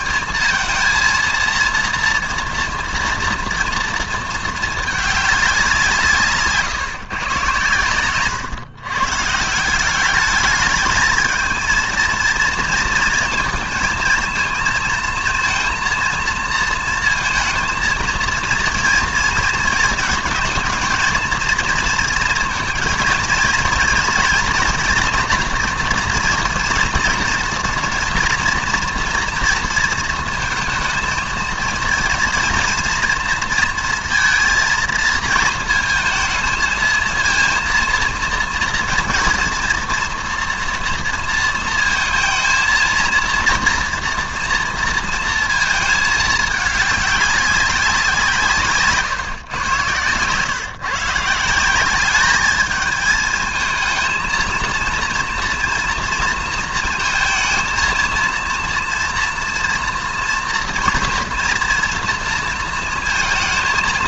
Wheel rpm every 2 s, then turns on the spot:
230, 230, 220, 140, 140, 210, 230, 220, 230, 230, 220, 230, 240, 230, 230, 220, 230, 230, 220, 240, 230, 230, 230, 200, 150, 140, 220, 230, 230, 230, 230, 230.
48-50